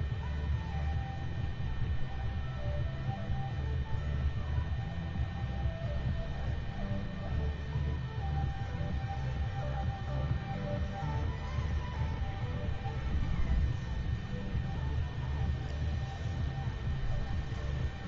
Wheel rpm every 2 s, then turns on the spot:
0, 0, 0, 0, 0, 0, 0, 0, 0.
none